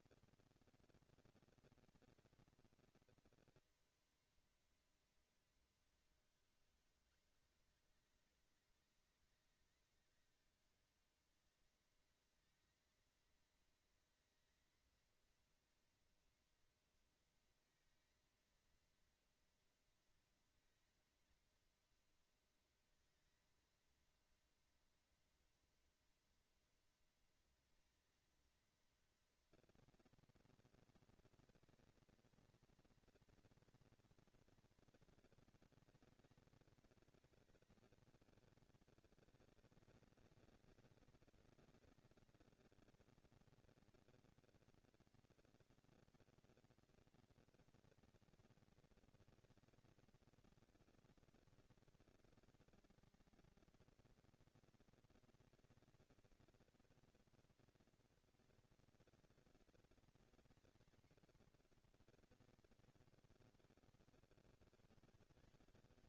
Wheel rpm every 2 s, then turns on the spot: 230, 230, 230, 200, 200, 210, 220, 230, 230, 230, 230, 230, 230, 230, 230, 230, 230, 230, 220, 200, 190, 210, 230, 240, 230, 230, 230, 230, 230, 220, 240, 160, 130.
none